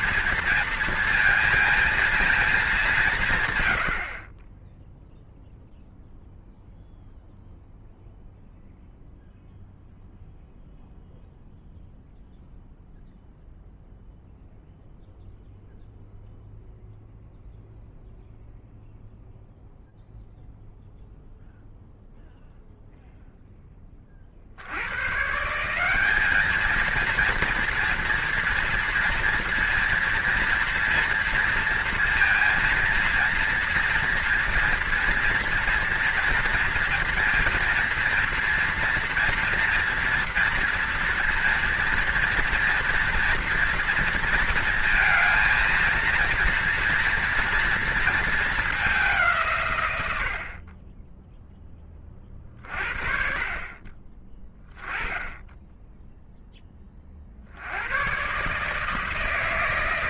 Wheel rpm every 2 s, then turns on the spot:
230, 200, 10, 0, 0, 0, 0, 0, 0, 0, 0, 0, 100, 220, 230, 230, 230, 230, 230, 230, 230, 230, 230, 230, 200, 20, 40, 20, 20, 150.
none